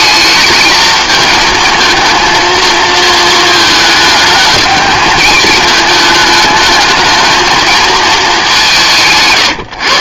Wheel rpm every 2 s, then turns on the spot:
220, 230, 210, 220, 200.
none